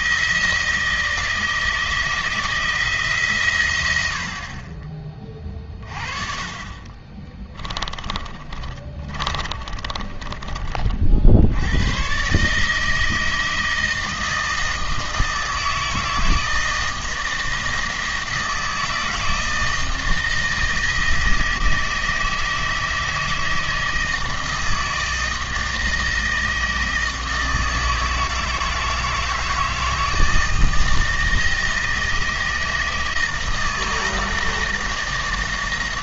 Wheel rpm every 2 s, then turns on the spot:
160, 160, 30, 30, 40, 40, 160, 160, 160, 170, 160, 160, 160, 160, 160, 160, 160, 160.
6-10